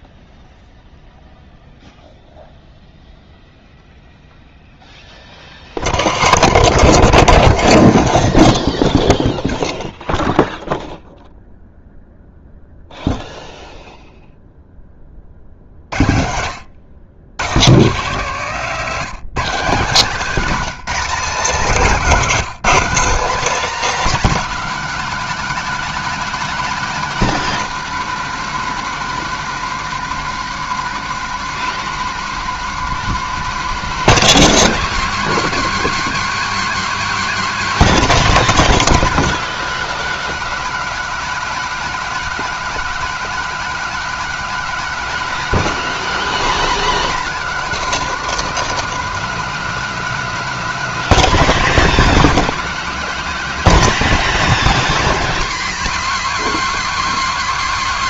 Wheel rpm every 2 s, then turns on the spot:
0, 0, 0, 0, 0, 0, 0, 0, 100, 200, 230, 240, 260, 250, 220, 220, 220, 230, 250, 250, 250, 250, 250, 260, 230, 250, 240, 250, 230.
none